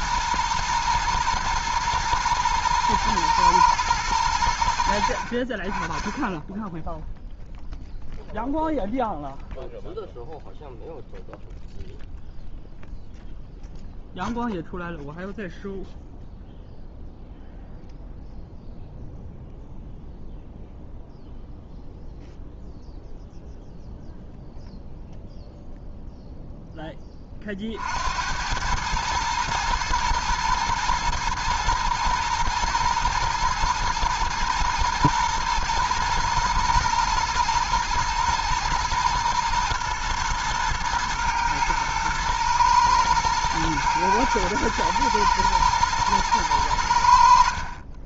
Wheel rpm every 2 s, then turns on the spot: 120, 110, 80, 10, 0, 0, 0, 0, 0, 0, 0, 0, 0, 0, 100, 110, 120, 110, 110, 120, 110, 110, 120, 100.
none